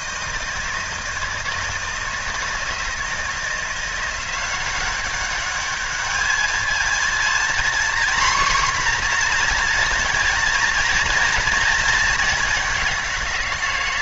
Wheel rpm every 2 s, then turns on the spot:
160, 160, 190, 230, 250, 230, 200.
none